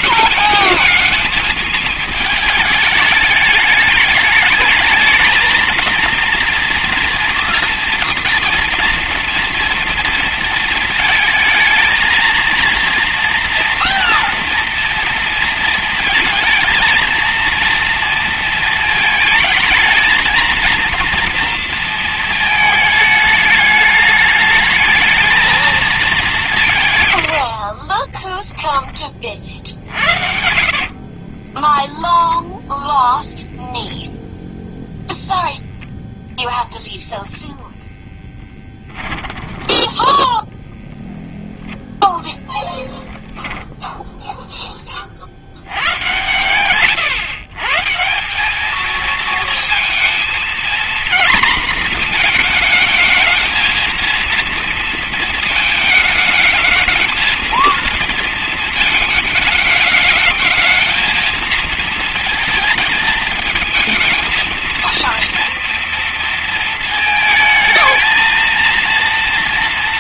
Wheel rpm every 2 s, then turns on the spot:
220, 220, 210, 230, 230, 230, 230, 230, 220, 230, 230, 220, 210, 180, 20, 60, 0, 0, 0, 10, 0, 0, 10, 110, 190, 230, 220, 230, 220, 230, 220, 230, 230, 230, 230.
28-32 38-40